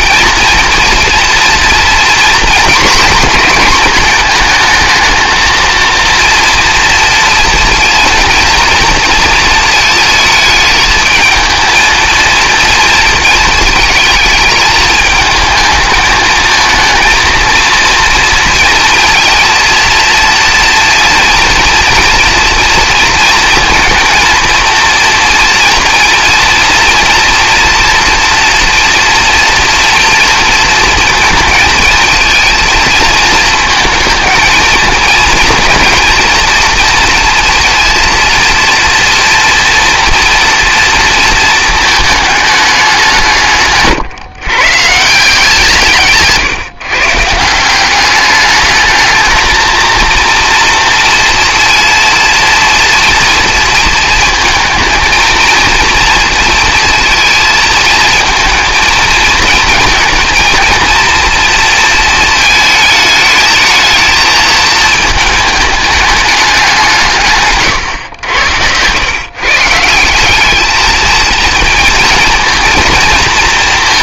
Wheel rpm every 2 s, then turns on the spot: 230, 240, 220, 230, 230, 220, 230, 220, 230, 230, 230, 230, 230, 230, 230, 230, 220, 220, 230, 230, 230, 200, 130, 140, 210, 230, 230, 230, 230, 230, 230, 220, 220, 190, 90, 210, 230.
none